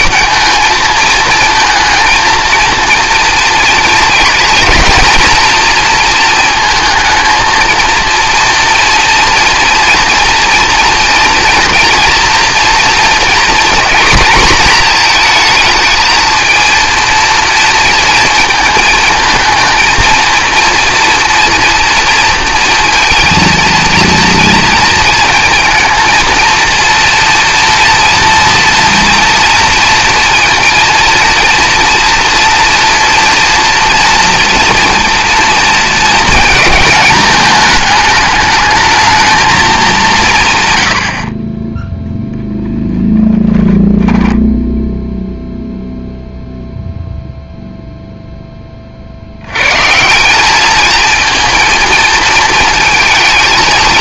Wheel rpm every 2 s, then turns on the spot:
220, 230, 240, 220, 230, 230, 240, 240, 230, 230, 230, 230, 230, 230, 230, 230, 230, 230, 220, 210, 130, 10, 10, 0, 10, 200, 220.
none